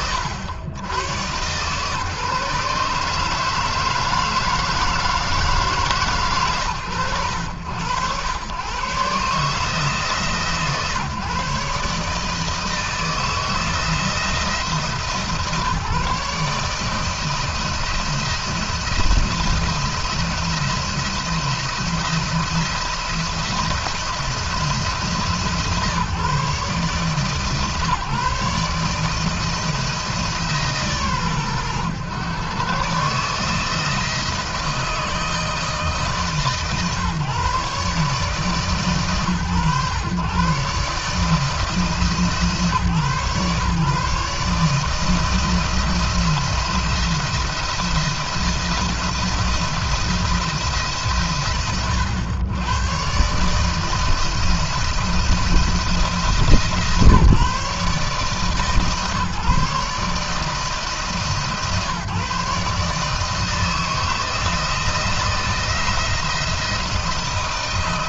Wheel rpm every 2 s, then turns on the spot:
110, 150, 160, 120, 120, 150, 160, 160, 150, 170, 170, 170, 170, 150, 160, 140, 130, 160, 150, 140, 130, 150, 150, 170, 170, 130, 120, 170, 140, 140, 150, 150, 160, 170.
none